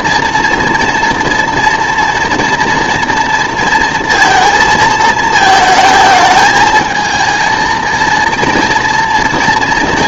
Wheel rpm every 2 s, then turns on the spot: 240, 230, 220, 220, 230.
none